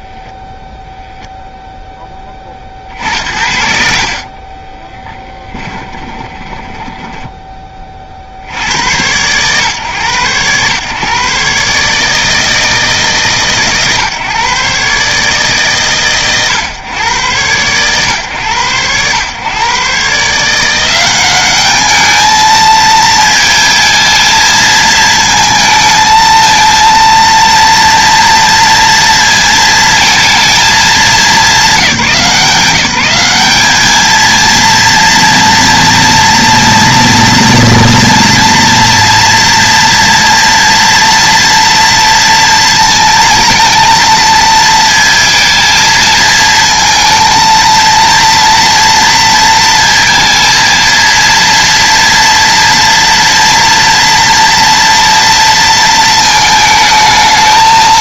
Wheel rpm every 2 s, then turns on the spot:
0, 60, 10, 10, 100, 130, 150, 140, 100, 120, 180, 220, 230, 230, 230, 220, 200, 230, 230, 230, 230, 230, 230, 230, 230, 230, 230, 230, 220.
2-8